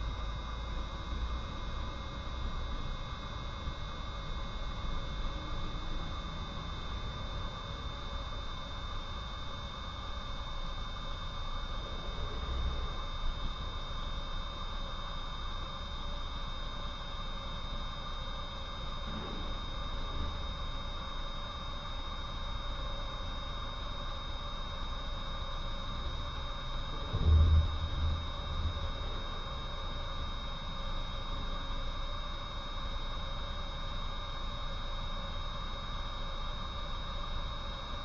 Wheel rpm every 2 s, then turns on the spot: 0, 0, 0, 0, 0, 0, 0, 0, 0, 0, 0, 0, 0, 0, 0, 0, 0, 0, 0.
none